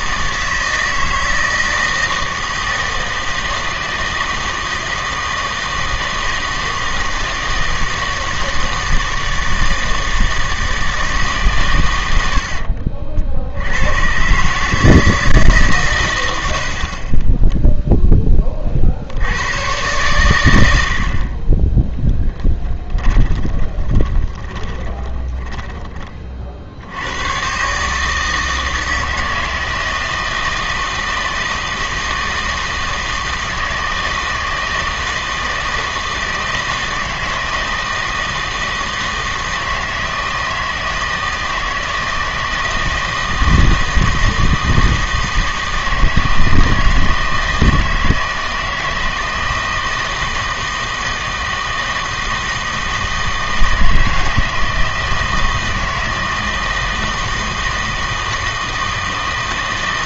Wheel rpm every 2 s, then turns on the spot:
160, 160, 160, 160, 160, 160, 60, 150, 60, 40, 90, 10, 20, 80, 160, 160, 160, 160, 160, 160, 160, 160, 160, 160, 160, 160, 160, 160, 160, 160.
22-26